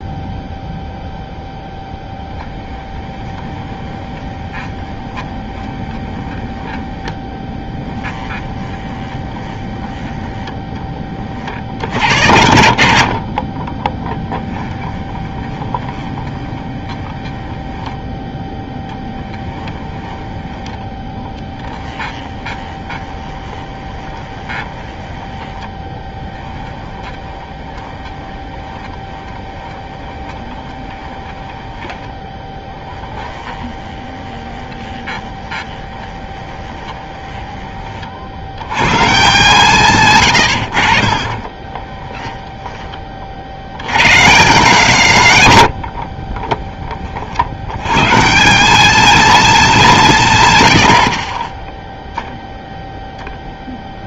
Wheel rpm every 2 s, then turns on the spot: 0, 10, 20, 20, 20, 10, 90, 10, 20, 10, 20, 20, 20, 10, 20, 20, 10, 20, 20, 100, 90, 10, 170, 30, 190, 120, 0.
2-6 8-10 14-20 22-38 40-42 46-48